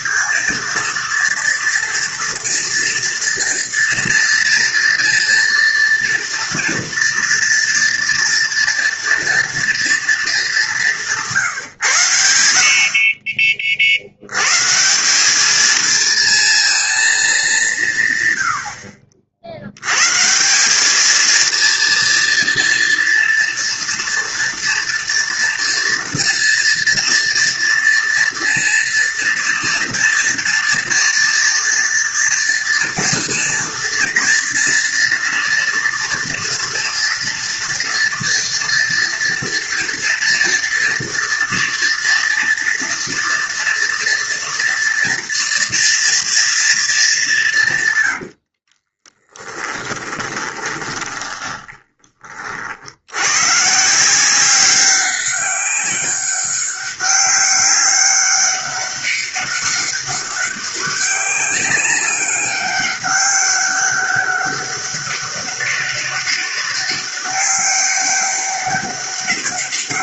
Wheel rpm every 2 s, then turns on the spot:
230, 240, 230, 230, 230, 190, 60, 150, 230, 80, 200, 230, 230, 230, 230, 230, 230, 230, 230, 230, 230, 230, 230, 230, 50, 20, 60, 190, 190, 200, 200, 200, 200, 200, 200.
48-52